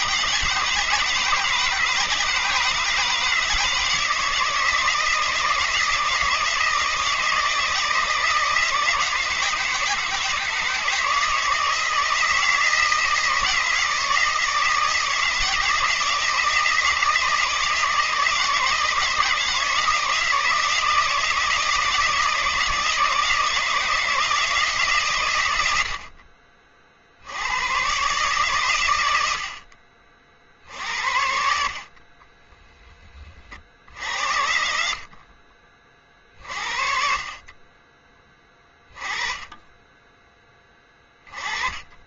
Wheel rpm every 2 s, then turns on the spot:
160, 150, 160, 160, 160, 160, 160, 160, 160, 160, 160, 160, 150, 40, 130, 60, 10, 70, 50, 20, 10.
32-34